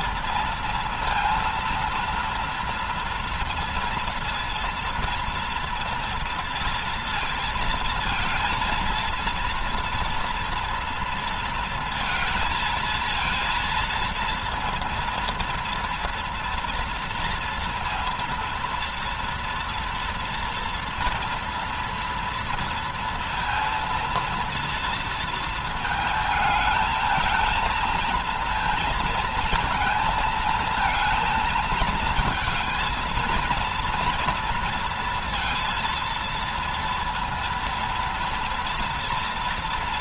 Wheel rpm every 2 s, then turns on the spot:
220, 230, 230, 230, 230, 230, 230, 230, 230, 230, 230, 230, 230, 220, 230, 220, 220, 230, 230, 230.
none